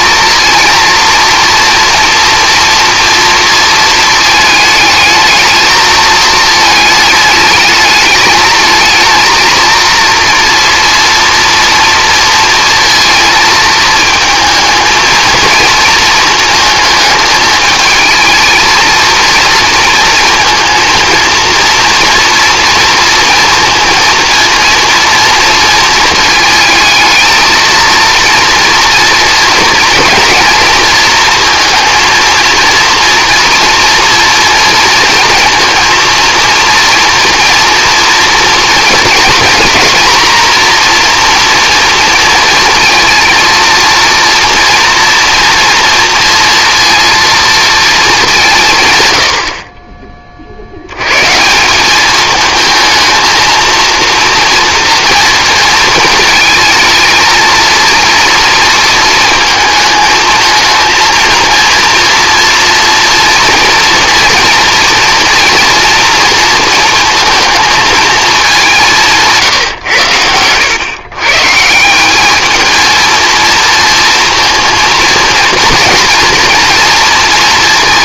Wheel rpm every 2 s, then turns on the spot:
230, 240, 220, 220, 220, 230, 220, 220, 220, 230, 230, 230, 230, 220, 230, 230, 230, 230, 230, 230, 230, 230, 230, 230, 140, 80, 220, 230, 220, 230, 220, 230, 230, 230, 180, 110, 220, 230, 230.
none